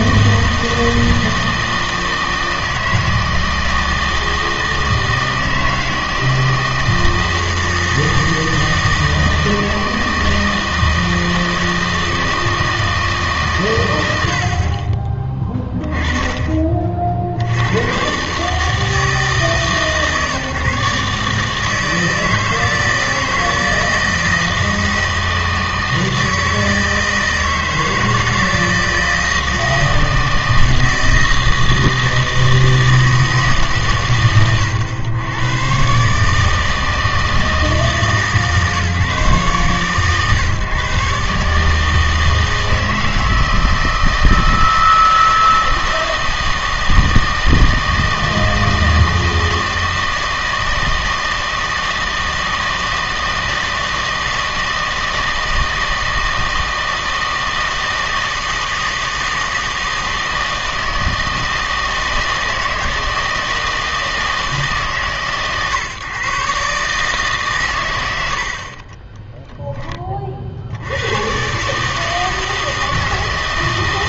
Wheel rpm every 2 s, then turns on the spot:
160, 160, 160, 160, 160, 160, 160, 40, 30, 150, 140, 160, 160, 160, 160, 160, 160, 120, 160, 150, 140, 160, 160, 160, 160, 160, 160, 160, 160, 160, 160, 160, 150, 140, 40, 70, 160.
68-70